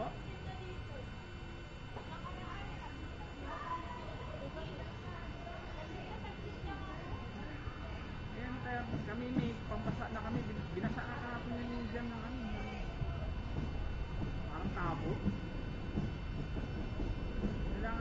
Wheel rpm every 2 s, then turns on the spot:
0, 0, 0, 0, 0, 0, 0, 0, 0.
none